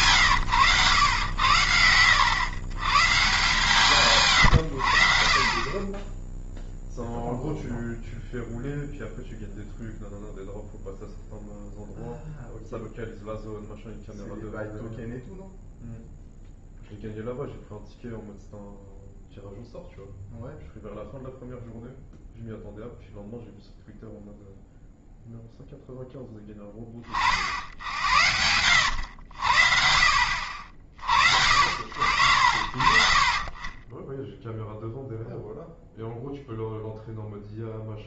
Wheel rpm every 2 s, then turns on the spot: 100, 110, 100, 0, 0, 0, 0, 0, 0, 0, 0, 0, 0, 30, 90, 60, 60, 0, 0.
32-34